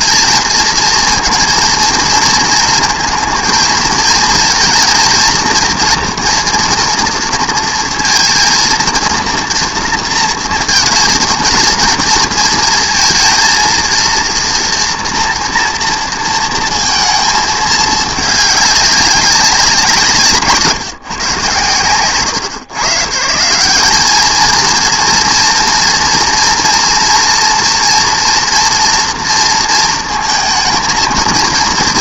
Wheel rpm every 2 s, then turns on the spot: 230, 230, 240, 230, 230, 230, 230, 230, 210, 180, 130, 180, 230, 230, 230, 230.
none